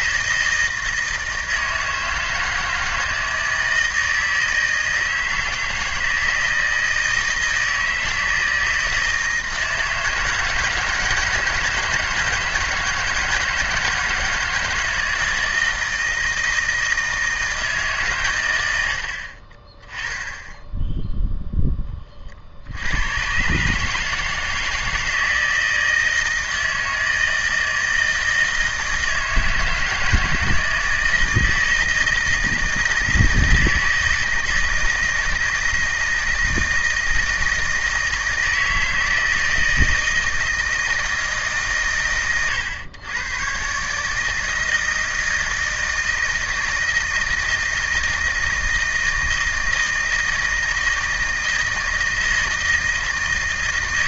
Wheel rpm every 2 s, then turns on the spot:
160, 160, 160, 160, 160, 160, 160, 160, 160, 100, 10, 70, 160, 160, 160, 160, 160, 160, 160, 160, 160, 110, 160, 160, 160, 160, 160.
none